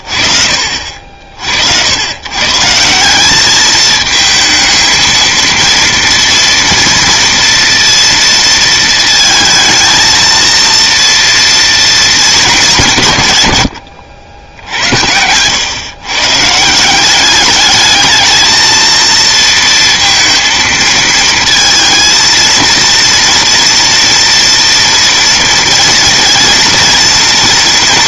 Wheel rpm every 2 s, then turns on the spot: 50, 150, 220, 230, 230, 230, 190, 80, 140, 220, 230, 220, 230, 230.
none